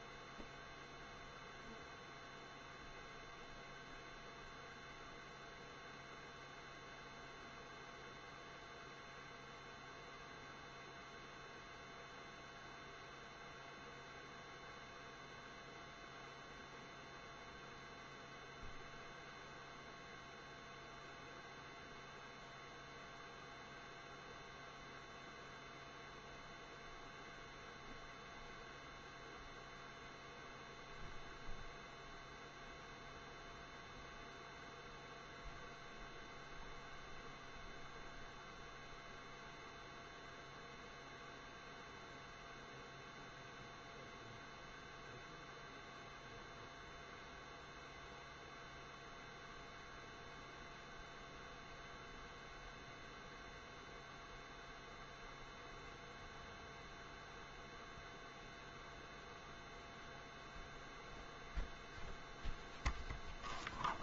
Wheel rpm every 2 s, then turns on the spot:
0, 0, 0, 0, 0, 0, 0, 0, 0, 0, 0, 0, 0, 0, 0, 0, 0, 0, 0, 0, 0, 0, 0, 0, 0, 0, 0, 0, 0, 0, 0, 0.
none